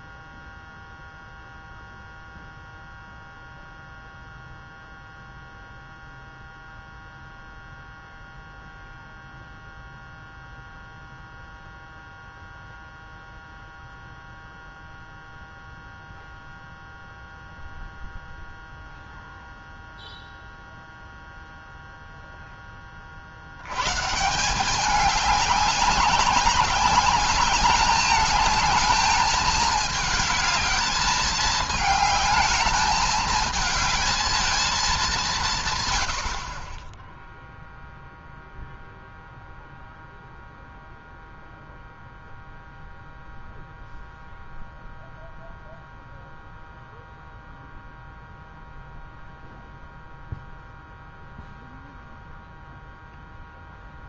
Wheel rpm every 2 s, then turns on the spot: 0, 0, 0, 0, 0, 0, 0, 0, 0, 0, 0, 10, 180, 190, 210, 220, 210, 210, 40, 0, 0, 0, 0, 0, 0, 0, 0.
none